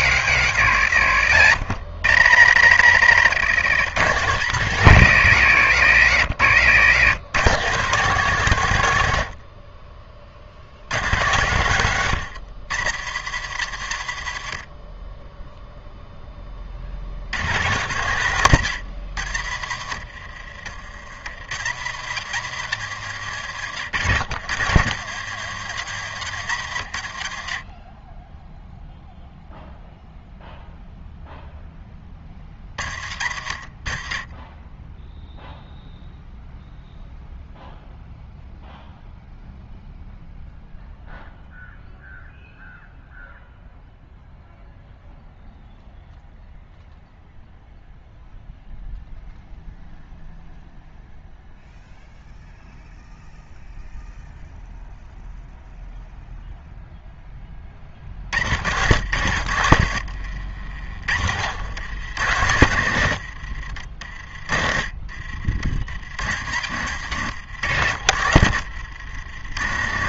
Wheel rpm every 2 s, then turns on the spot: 80, 110, 120, 90, 120, 80, 110, 40, 50, 100, 50, 110, 100, 80, 0, 0, 60, 10, 0, 0, 0, 0, 0, 0, 0, 0, 0, 0, 0, 90, 50, 90, 40, 100, 80.
2-4 6-8 58-64